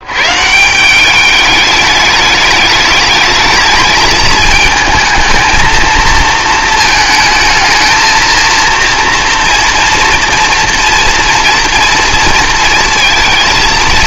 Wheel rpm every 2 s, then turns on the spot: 140, 210, 220, 220, 230, 230, 230.
none